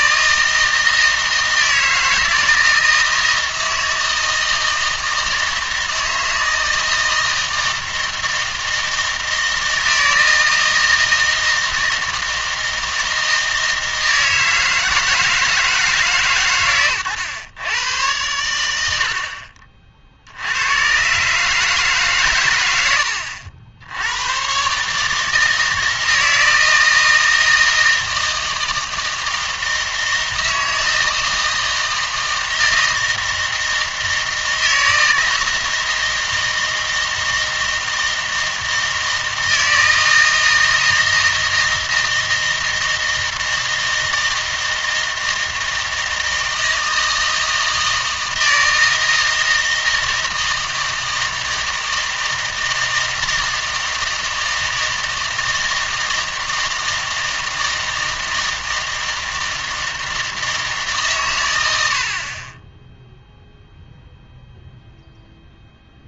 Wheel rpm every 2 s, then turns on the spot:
160, 160, 160, 160, 160, 160, 160, 160, 130, 100, 90, 100, 140, 160, 160, 160, 160, 160, 160, 160, 160, 160, 160, 160, 160, 160, 160, 160, 160, 160, 150, 10, 0.
none